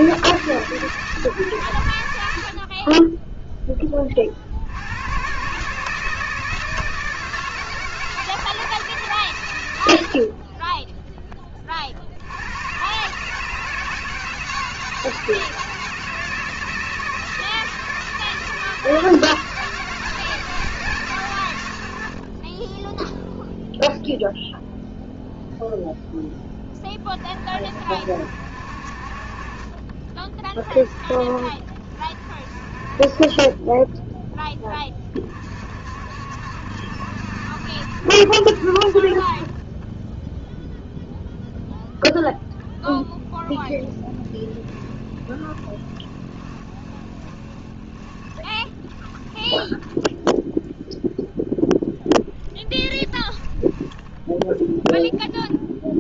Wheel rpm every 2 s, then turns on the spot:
150, 60, 70, 160, 160, 30, 100, 160, 160, 160, 150, 20, 0, 10, 60, 30, 50, 10, 60, 60, 0, 0, 20, 20, 20, 0, 10, 0.
44-50 52-54